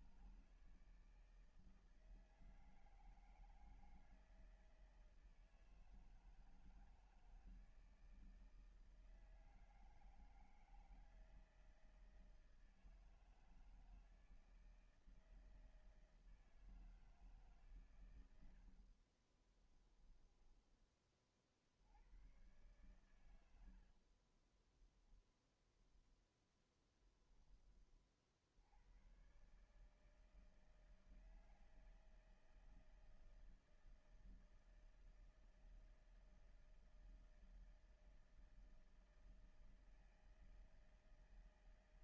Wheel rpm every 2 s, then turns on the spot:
160, 160, 160, 160, 160, 160, 160, 160, 150, 40, 30, 110, 0, 10, 90, 160, 160, 160, 160, 160, 160.
18-20